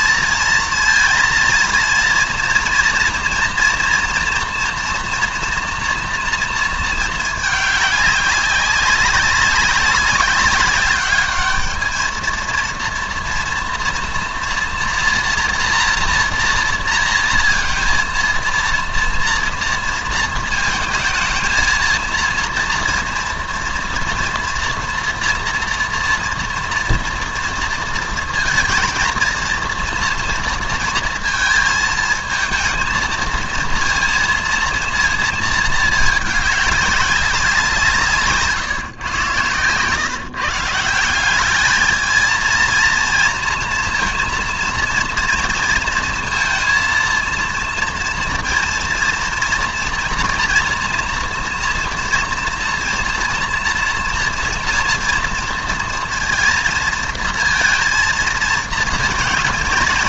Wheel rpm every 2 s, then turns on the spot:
230, 230, 230, 230, 200, 200, 230, 230, 230, 230, 220, 240, 230, 230, 230, 230, 230, 230, 200, 140, 160, 230, 240, 230, 230, 230, 230, 240, 230, 230.
none